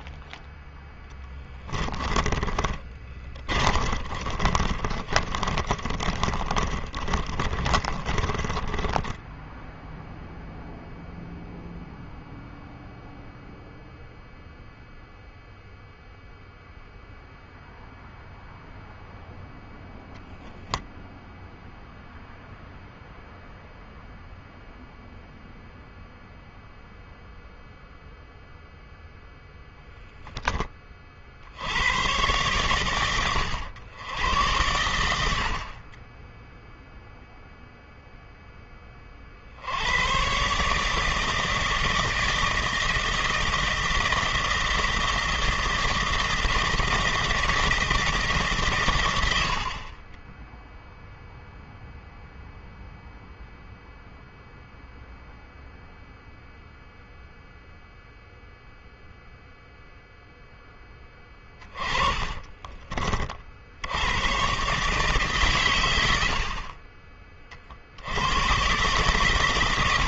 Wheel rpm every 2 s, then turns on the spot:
10, 30, 30, 30, 10, 0, 0, 0, 0, 0, 10, 0, 0, 0, 10, 40, 110, 90, 0, 30, 160, 160, 160, 160, 120, 0, 0, 0, 0, 0, 20, 40, 130, 30, 140.
0-10